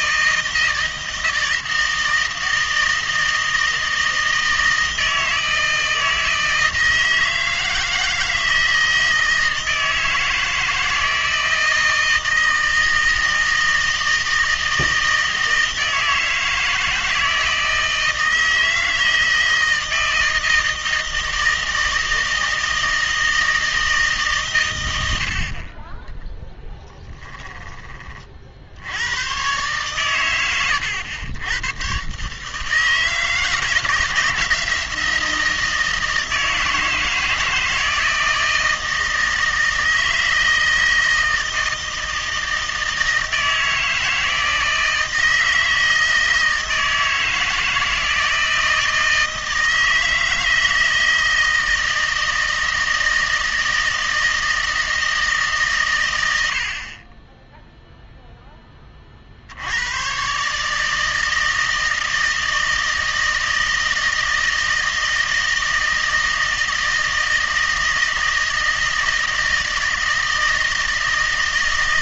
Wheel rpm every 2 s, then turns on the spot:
160, 160, 160, 160, 160, 160, 160, 160, 160, 160, 160, 160, 110, 10, 70, 100, 160, 170, 160, 160, 160, 160, 160, 160, 160, 160, 160, 160, 60, 10, 150, 160, 160, 160, 160, 160.
26-28